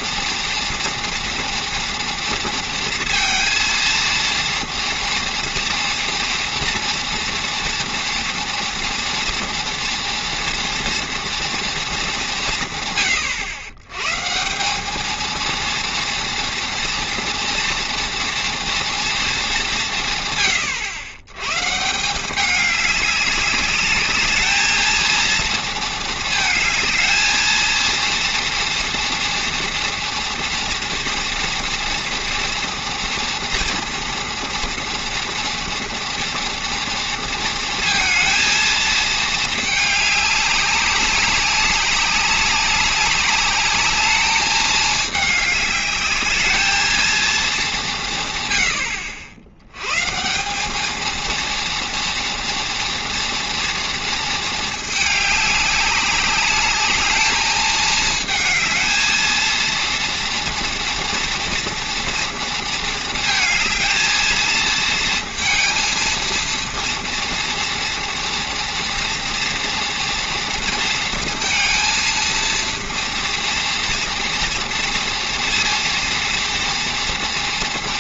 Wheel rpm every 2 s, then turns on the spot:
230, 230, 230, 240, 230, 230, 160, 190, 230, 230, 110, 200, 220, 220, 230, 230, 230, 230, 230, 230, 200, 200, 210, 220, 110, 190, 230, 220, 200, 220, 230, 230, 220, 230, 240, 230, 230, 230, 230.
none